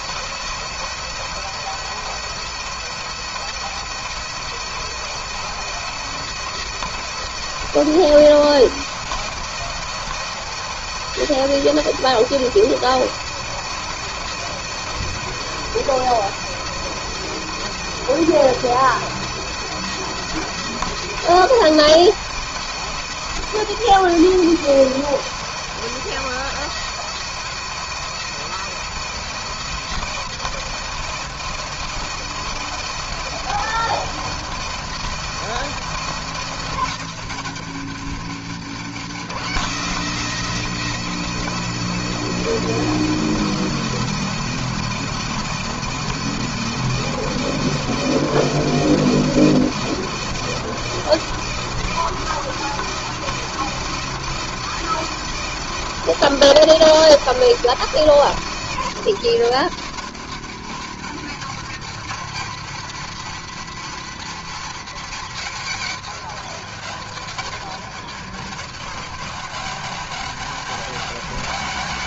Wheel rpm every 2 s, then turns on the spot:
170, 170, 170, 170, 170, 160, 170, 170, 170, 170, 170, 170, 170, 170, 170, 170, 170, 170, 170, 170, 160, 160, 170, 170, 170, 170, 170, 170, 170, 170, 170, 210, 230, 190, 170, 170.
none